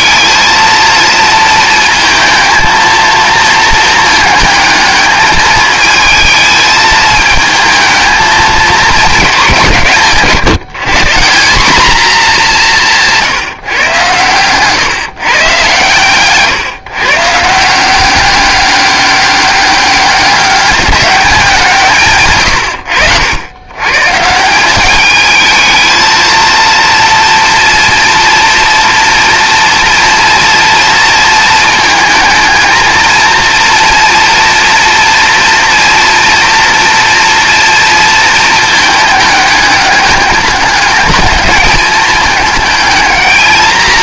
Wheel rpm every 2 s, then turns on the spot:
230, 220, 220, 220, 210, 160, 180, 130, 150, 200, 200, 100, 190, 230, 240, 230, 230, 230, 230, 220, 210, 220.
none